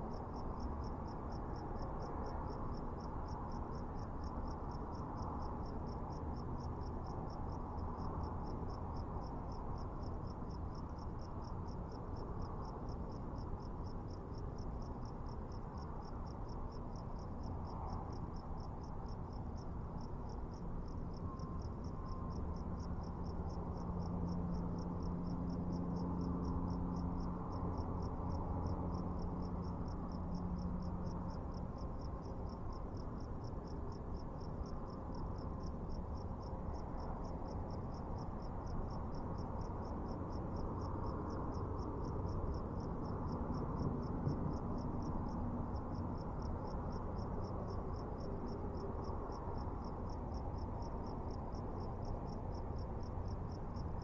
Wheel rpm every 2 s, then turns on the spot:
0, 0, 0, 0, 0, 0, 0, 0, 0, 0, 0, 0, 0, 0, 0, 0, 0, 0, 0, 0, 0, 0, 0, 0, 0, 0, 0.
none